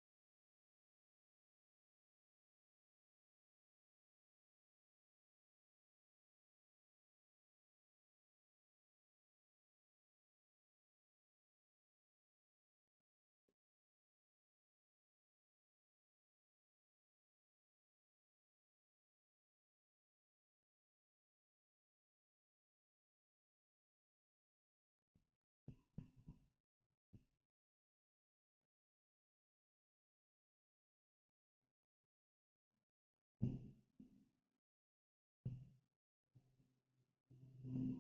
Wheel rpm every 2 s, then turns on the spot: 0, 0, 0, 0, 0, 0, 0, 0, 0, 0, 0, 0, 0, 0, 0, 0, 0, 0, 0.
none